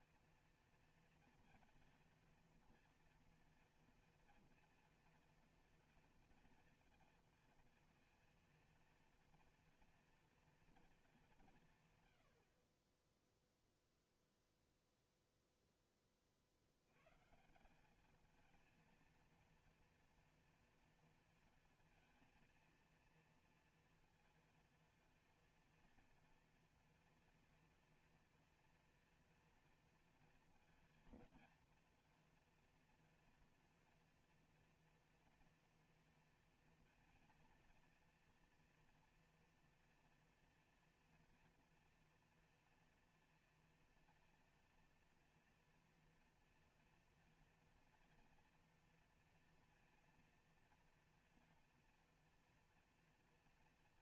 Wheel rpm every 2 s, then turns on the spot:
230, 230, 230, 230, 230, 230, 40, 0, 80, 230, 230, 230, 230, 240, 230, 230, 230, 230, 230, 240, 230, 240, 230, 230, 230, 230, 230.
none